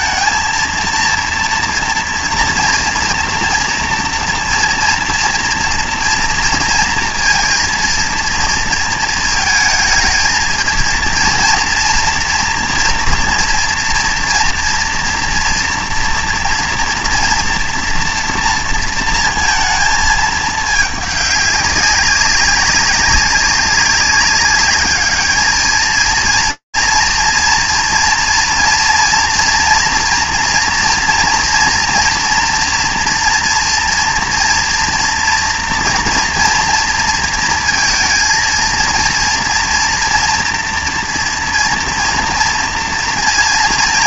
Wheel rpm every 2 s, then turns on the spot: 230, 230, 230, 230, 230, 230, 230, 230, 240, 230, 210, 190, 200, 230, 230, 230, 230, 240, 230, 230, 230, 230.
none